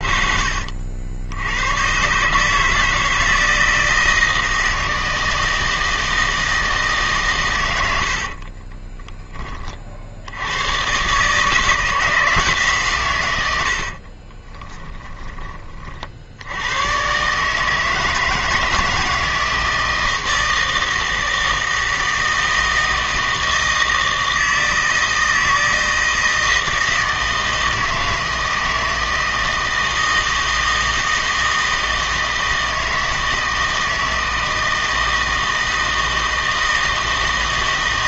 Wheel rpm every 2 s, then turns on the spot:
70, 160, 160, 160, 30, 110, 150, 20, 100, 160, 160, 160, 160, 160, 160, 160, 160, 160, 160.
8-10 14-16